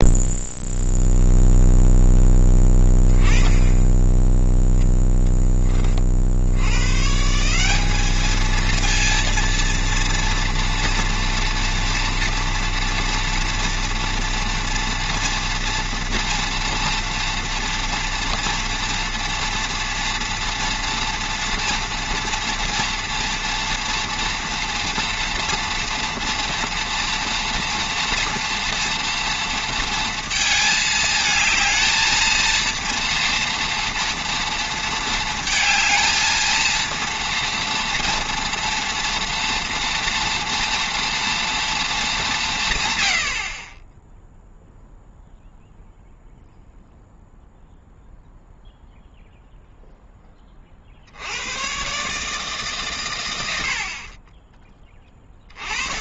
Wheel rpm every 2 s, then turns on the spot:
0, 10, 0, 100, 230, 230, 230, 230, 240, 240, 230, 230, 230, 230, 230, 220, 230, 230, 230, 240, 240, 130, 0, 0, 0, 50, 150, 20.
none